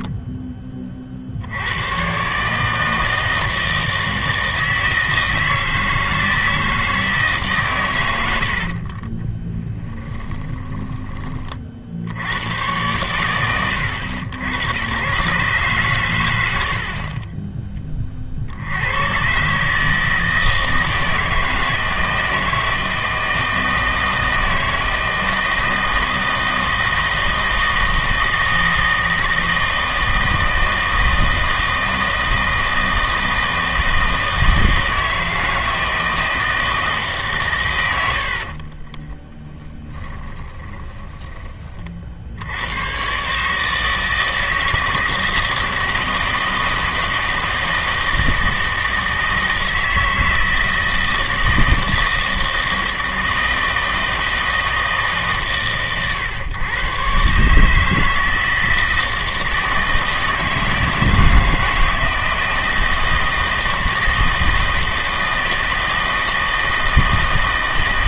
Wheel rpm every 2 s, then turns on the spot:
20, 160, 160, 160, 40, 10, 110, 90, 70, 80, 160, 160, 160, 160, 160, 160, 160, 160, 160, 30, 10, 100, 160, 160, 160, 160, 160, 160, 120, 160, 160, 160, 160, 160.
8-12 38-42